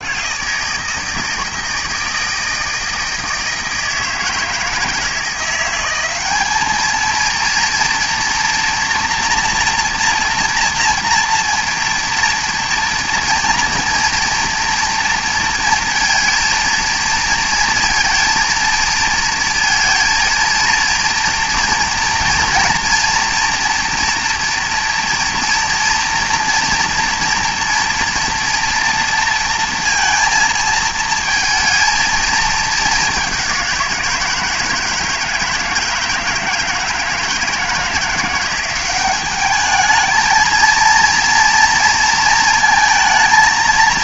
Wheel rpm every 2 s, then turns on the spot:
160, 160, 160, 210, 230, 230, 230, 230, 230, 230, 230, 230, 230, 230, 230, 220, 210, 170, 160, 180, 220, 220.
none